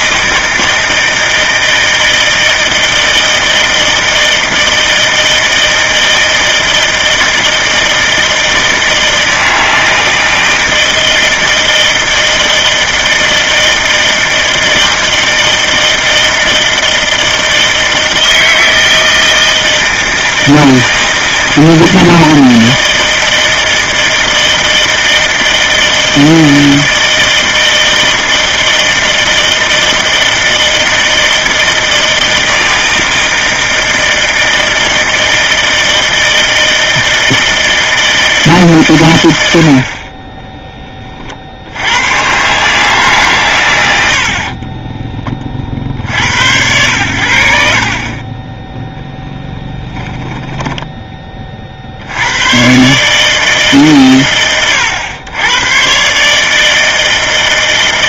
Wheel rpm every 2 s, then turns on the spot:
160, 160, 160, 160, 160, 160, 160, 160, 160, 160, 160, 160, 160, 160, 160, 160, 160, 160, 160, 140, 20, 130, 40, 100, 20, 10, 110, 90, 150.
48-52